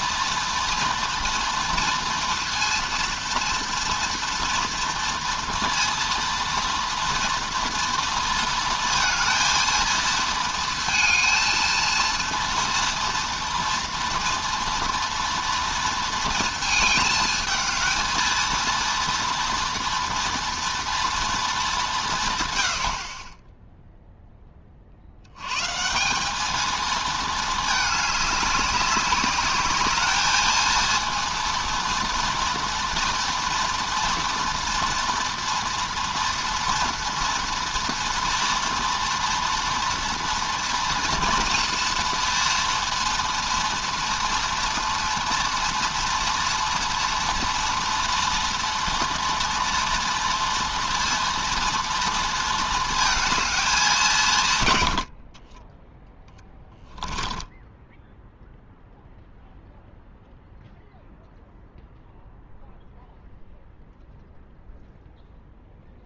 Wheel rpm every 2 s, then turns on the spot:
230, 230, 230, 230, 230, 230, 230, 230, 220, 230, 230, 70, 30, 220, 200, 220, 230, 230, 230, 230, 230, 230, 230, 230, 230, 230, 230, 110, 10, 0, 0, 0, 0.
56-58